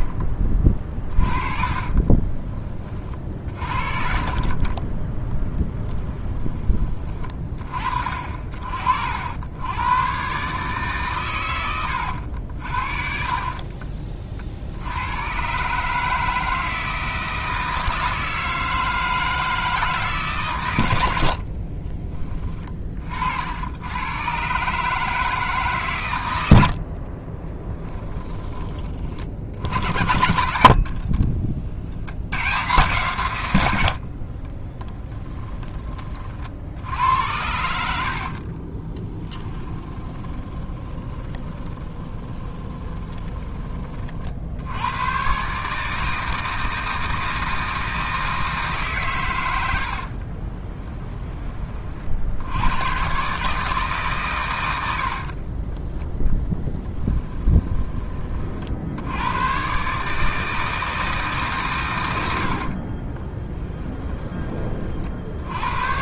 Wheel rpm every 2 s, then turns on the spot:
30, 30, 40, 20, 60, 140, 60, 60, 160, 160, 120, 20, 130, 90, 20, 60, 130, 20, 60, 40, 30, 20, 70, 160, 160, 30, 90, 100, 10, 50, 160, 60, 30.
0-2 4-8 30-32 34-36 38-44 50-52 56-58 62-64